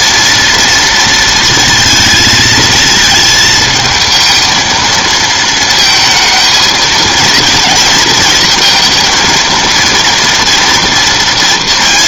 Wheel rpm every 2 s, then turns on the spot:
230, 220, 230, 220, 230, 240.
none